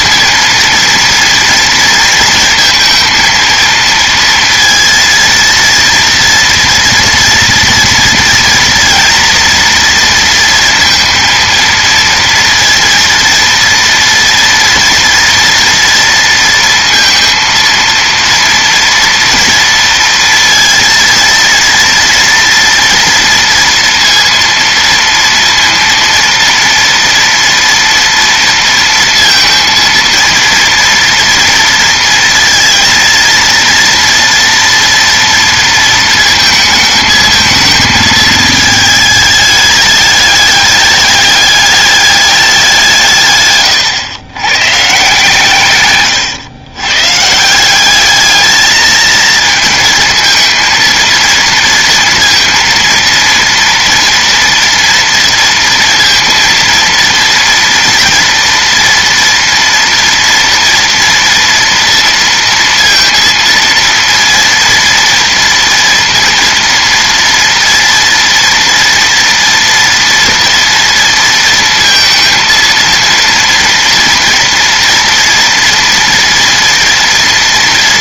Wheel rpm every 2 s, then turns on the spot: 230, 230, 230, 230, 230, 230, 230, 230, 230, 230, 230, 230, 230, 230, 230, 230, 230, 240, 220, 220, 210, 170, 140, 130, 220, 230, 230, 230, 230, 230, 230, 230, 230, 230, 230, 230, 230, 230, 230.
none